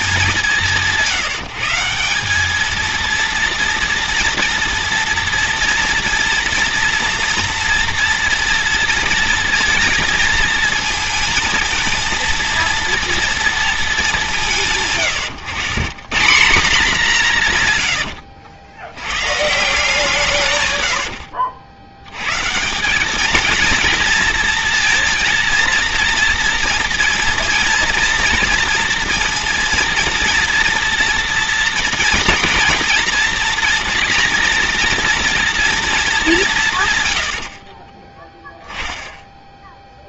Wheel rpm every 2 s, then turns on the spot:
170, 220, 230, 230, 240, 230, 230, 140, 200, 100, 100, 180, 230, 230, 230, 230, 230, 230, 140, 0.
20-22